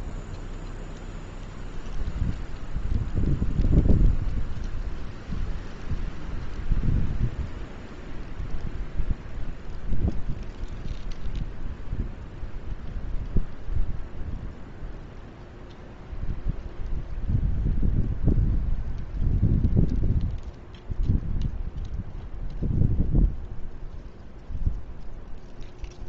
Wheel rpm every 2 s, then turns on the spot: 0, 0, 0, 0, 0, 0, 0, 0, 0, 0, 0, 0, 0.
none